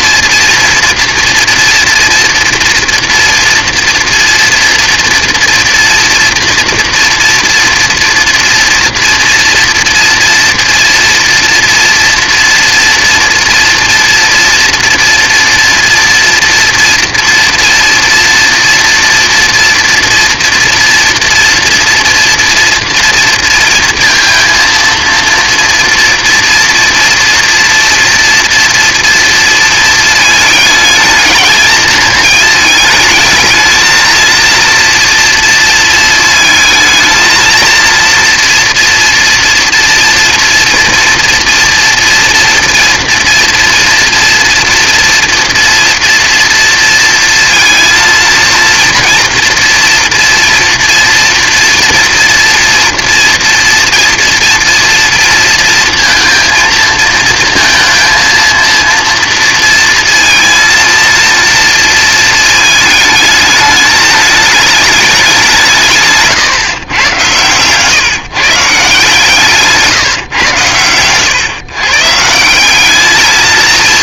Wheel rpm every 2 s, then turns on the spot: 240, 230, 230, 240, 230, 240, 230, 230, 230, 230, 230, 230, 230, 240, 230, 220, 220, 230, 220, 240, 230, 230, 230, 230, 230, 230, 230, 240, 230, 230, 230, 220, 210, 120, 150, 130, 190.
none